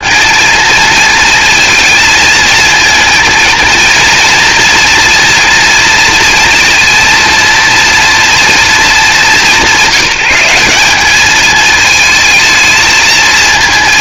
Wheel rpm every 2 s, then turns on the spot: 230, 230, 230, 230, 240, 190, 220.
none